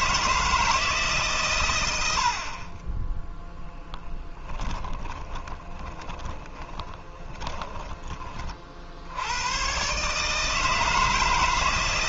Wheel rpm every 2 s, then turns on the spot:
150, 20, 10, 20, 80, 160.
4-8